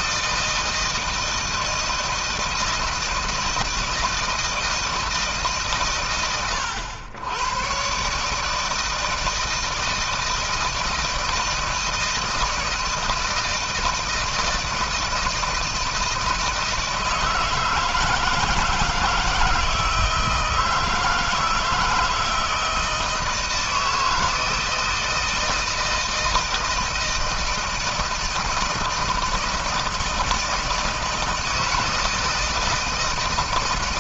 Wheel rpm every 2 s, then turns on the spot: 160, 160, 160, 110, 160, 160, 160, 160, 160, 160, 160, 160, 160, 160, 160, 160, 160.
none